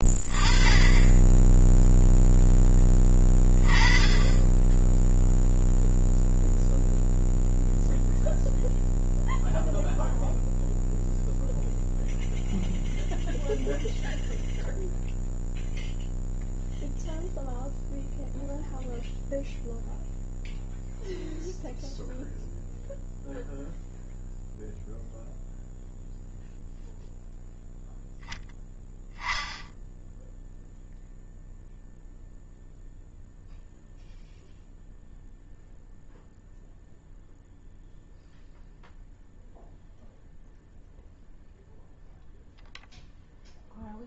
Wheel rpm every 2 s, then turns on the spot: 10, 10, 20, 0, 0, 0, 0, 0, 0, 0, 0, 0, 0, 0, 10, 0, 0, 0, 0, 0, 0, 0.
none